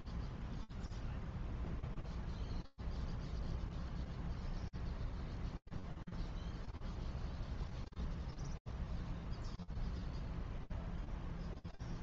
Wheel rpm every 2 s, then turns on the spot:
0, 0, 0, 0, 0, 0.
none